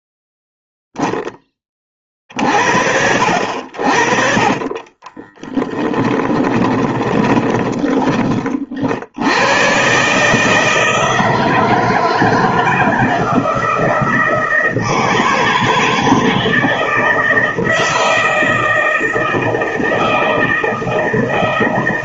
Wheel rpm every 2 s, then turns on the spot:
0, 70, 20, 20, 60, 160, 160, 160, 160, 160, 160.
4-8